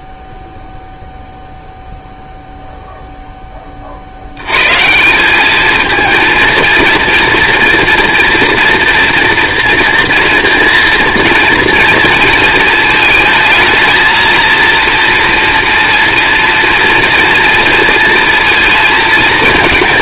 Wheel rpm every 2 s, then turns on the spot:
0, 0, 120, 230, 230, 230, 220, 230, 230, 220.
none